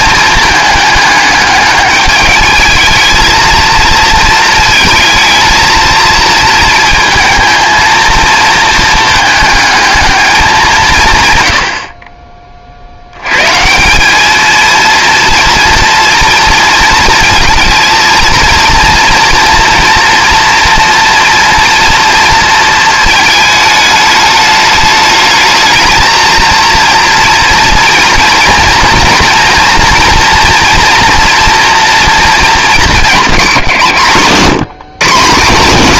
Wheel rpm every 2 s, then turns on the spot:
210, 220, 230, 220, 220, 170, 50, 230, 230, 230, 230, 220, 210, 230, 230, 230, 220, 150.
none